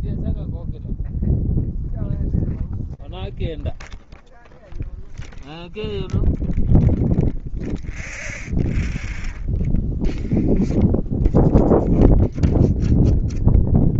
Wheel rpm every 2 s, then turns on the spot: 0, 0, 0, 0, 0, 0, 0.
none